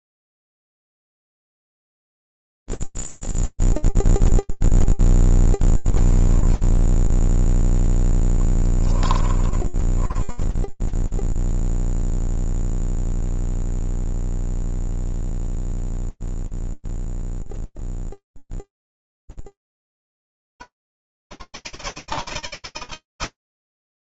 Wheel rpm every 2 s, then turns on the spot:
0, 0, 0, 0, 10, 0, 0, 0, 0, 0, 110, 160.
8-10